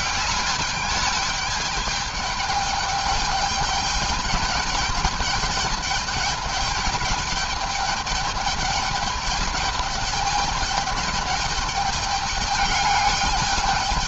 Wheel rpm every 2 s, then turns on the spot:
210, 210, 210, 210, 210, 210, 210.
none